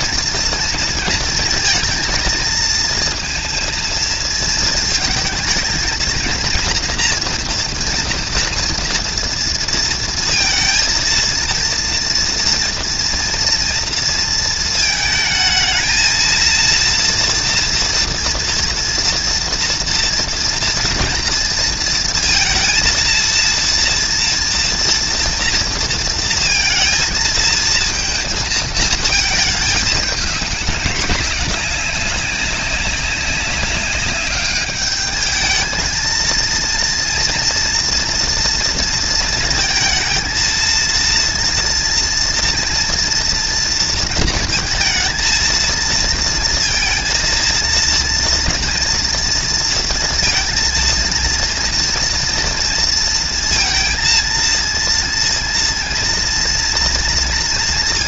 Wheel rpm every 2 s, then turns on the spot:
230, 230, 220, 230, 230, 230, 230, 220, 230, 230, 230, 230, 230, 230, 230, 200, 190, 210, 230, 230, 230, 230, 230, 230, 230, 230, 230, 230, 230.
none